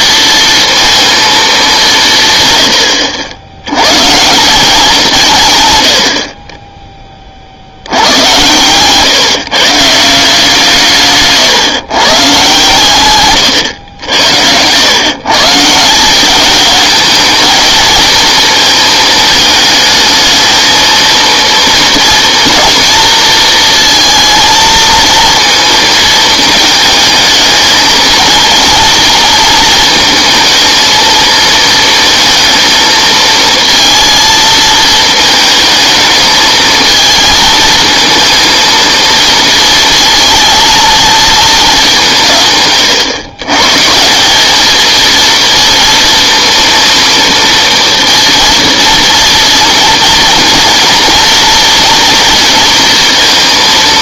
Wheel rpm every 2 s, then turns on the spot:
230, 120, 170, 30, 130, 160, 140, 100, 210, 230, 220, 230, 220, 220, 220, 230, 220, 230, 220, 230, 230, 130, 220, 240, 230, 230, 230.
none